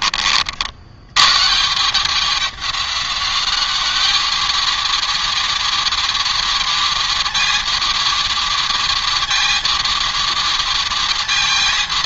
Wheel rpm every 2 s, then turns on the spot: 70, 190, 220, 220, 220, 220.
none